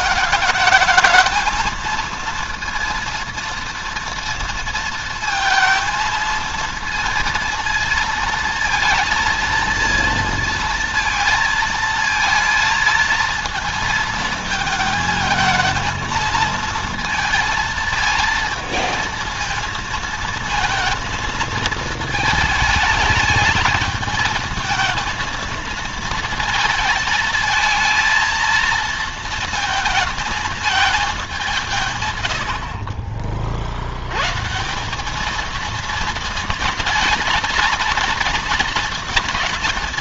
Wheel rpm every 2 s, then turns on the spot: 220, 230, 230, 230, 230, 230, 230, 220, 230, 230, 230, 220, 220, 220, 230, 220, 70, 180, 220, 220.
none